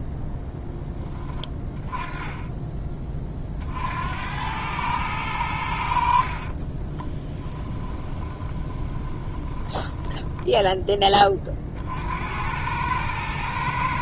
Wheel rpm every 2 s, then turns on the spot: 10, 20, 100, 30, 20, 10, 100.
6-10